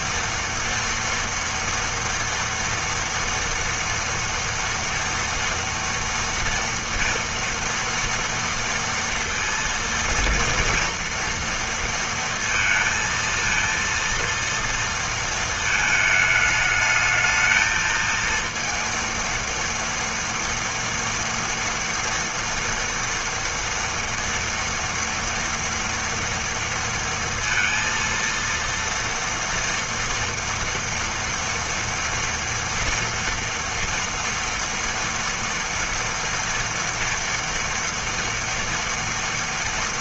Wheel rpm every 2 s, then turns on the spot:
240, 230, 230, 230, 230, 230, 230, 230, 210, 230, 230, 230, 240, 230, 230, 240, 230, 230, 230, 230.
none